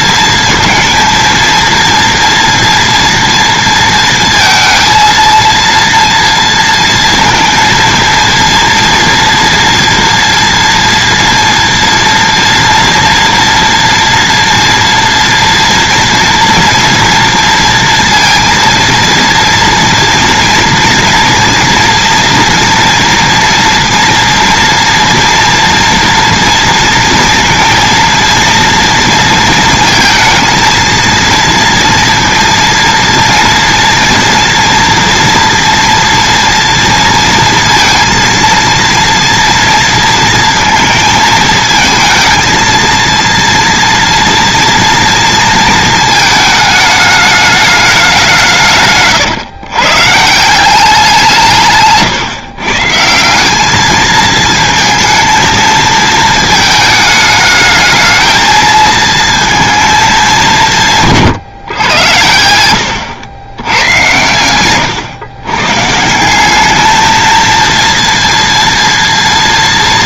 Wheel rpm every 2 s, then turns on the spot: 230, 230, 230, 230, 230, 230, 230, 230, 230, 230, 230, 240, 230, 230, 230, 230, 230, 230, 230, 230, 220, 230, 230, 220, 150, 180, 150, 220, 220, 220, 170, 90, 120, 210, 230.
64-66